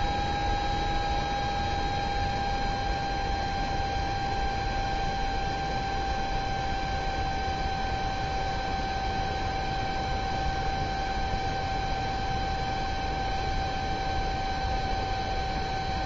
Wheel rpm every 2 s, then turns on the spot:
0, 0, 0, 0, 0, 0, 0, 0.
none